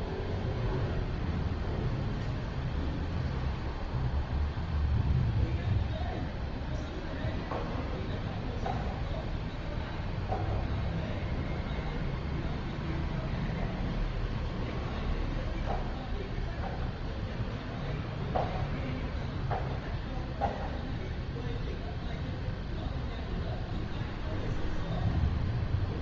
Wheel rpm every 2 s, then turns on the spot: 0, 0, 0, 0, 0, 0, 0, 0, 0, 0, 0, 0, 0.
none